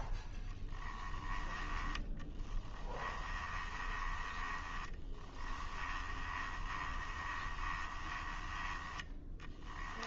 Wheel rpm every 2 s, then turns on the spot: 10, 20, 10, 20, 10.
2-10